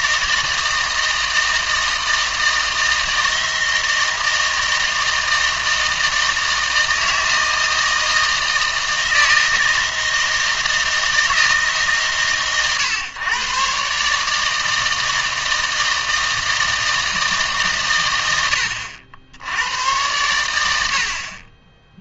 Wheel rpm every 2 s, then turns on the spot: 160, 160, 160, 160, 160, 160, 120, 160, 160, 80, 90.
none